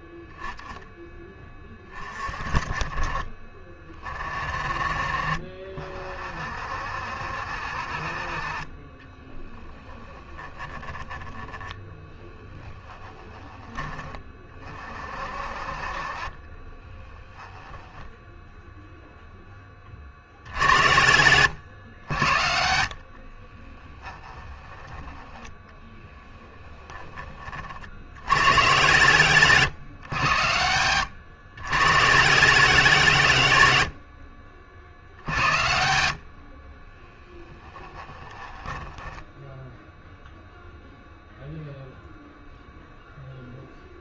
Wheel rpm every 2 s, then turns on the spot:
0, 30, 30, 60, 30, 10, 10, 30, 20, 0, 70, 70, 10, 20, 120, 100, 180, 60, 40, 10, 0, 0.
10-14 16-18 38-40